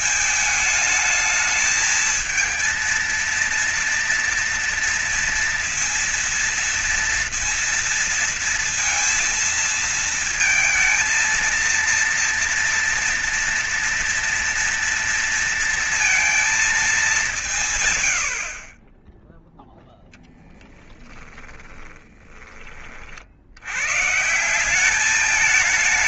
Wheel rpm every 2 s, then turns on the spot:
220, 230, 230, 230, 230, 230, 230, 230, 220, 50, 20, 40, 190.
20-22